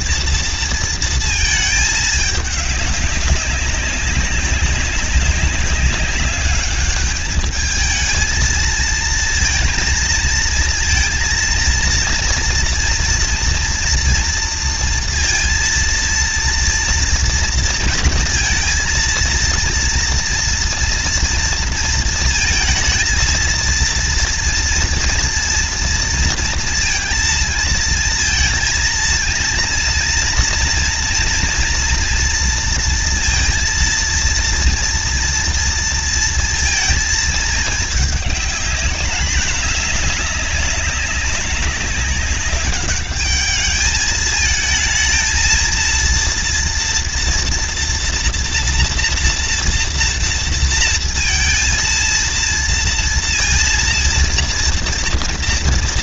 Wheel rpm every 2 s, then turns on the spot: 230, 210, 200, 200, 220, 230, 230, 230, 230, 230, 230, 230, 230, 230, 220, 230, 230, 230, 230, 210, 200, 200, 220, 230, 240, 230, 230, 230.
none